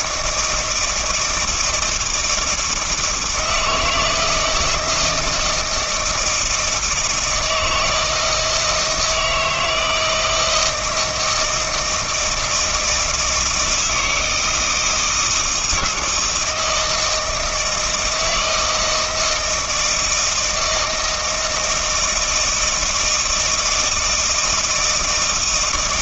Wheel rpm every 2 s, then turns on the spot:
160, 160, 160, 160, 160, 160, 160, 160, 160, 160, 160, 160, 160.
none